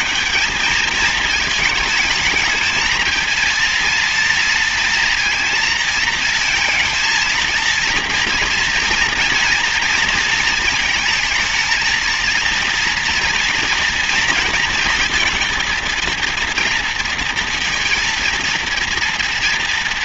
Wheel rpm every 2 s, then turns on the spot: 210, 220, 230, 230, 230, 230, 230, 230, 230, 230.
none